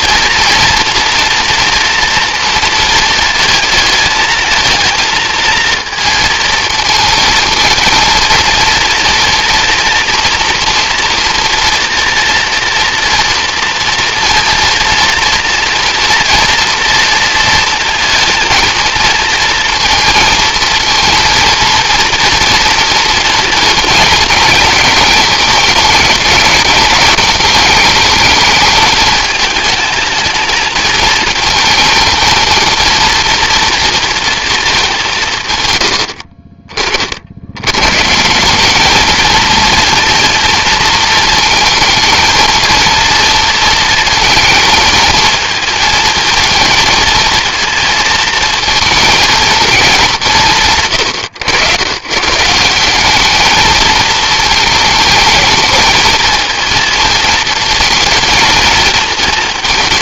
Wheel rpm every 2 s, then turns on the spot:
230, 230, 220, 230, 230, 240, 240, 230, 230, 230, 230, 230, 210, 210, 220, 220, 220, 220, 50, 180, 230, 230, 220, 230, 220, 110, 170, 220, 220, 220.
none